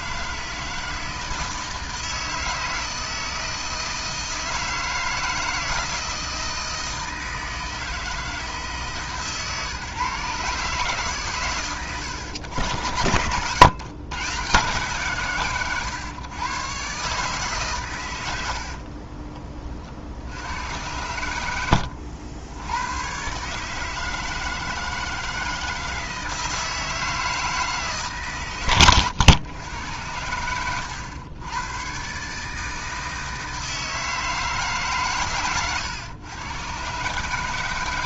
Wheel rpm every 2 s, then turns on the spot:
160, 160, 160, 160, 150, 140, 100, 140, 140, 50, 100, 110, 160, 160, 120, 100, 160, 140, 130.
18-20